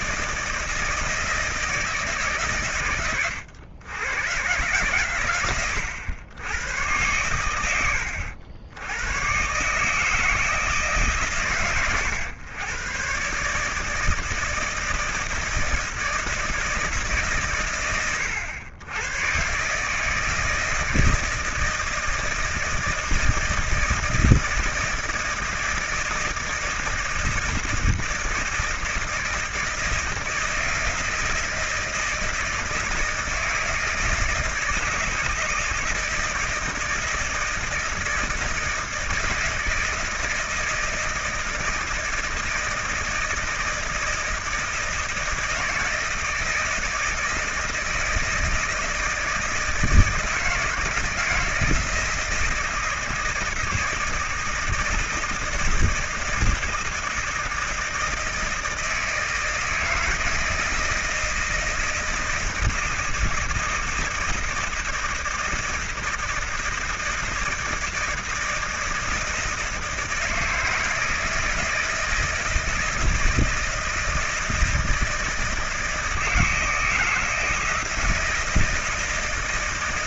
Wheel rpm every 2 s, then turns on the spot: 160, 140, 120, 110, 80, 160, 110, 160, 160, 90, 160, 160, 160, 160, 160, 160, 160, 160, 160, 160, 160, 160, 160, 160, 160, 170, 170, 160, 160, 160, 160, 160, 160, 160, 160, 160, 160, 160, 160, 170.
none